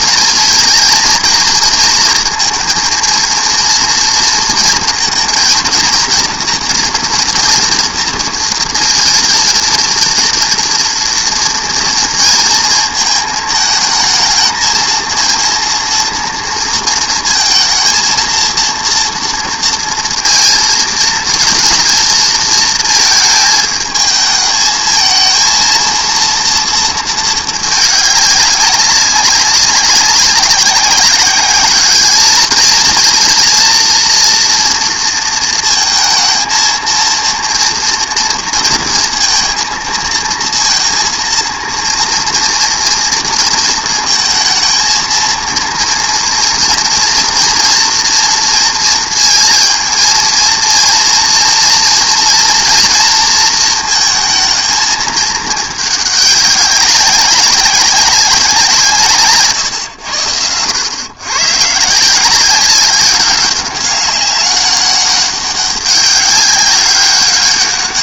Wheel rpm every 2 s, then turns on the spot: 220, 230, 230, 240, 230, 230, 230, 220, 230, 230, 230, 220, 220, 230, 200, 190, 220, 230, 230, 230, 230, 230, 220, 230, 230, 230, 230, 220, 190, 170, 100, 190, 200, 190.
none